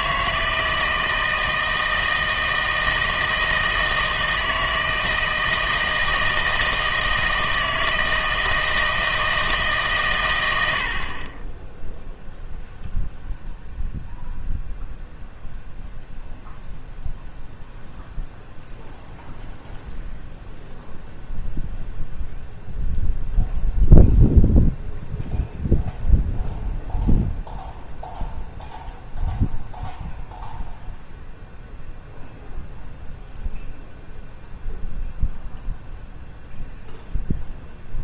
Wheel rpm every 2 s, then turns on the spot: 160, 160, 160, 160, 160, 90, 0, 0, 0, 0, 0, 0, 0, 0, 0, 0, 0, 0, 0.
none